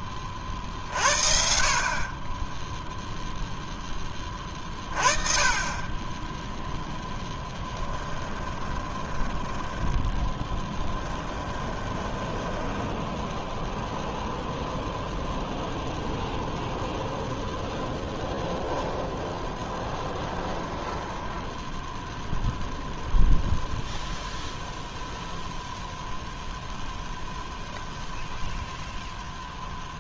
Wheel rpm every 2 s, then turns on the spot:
50, 0, 30, 0, 20, 10, 10, 0, 0, 0, 10, 0, 0, 0, 0.
8-14 20-22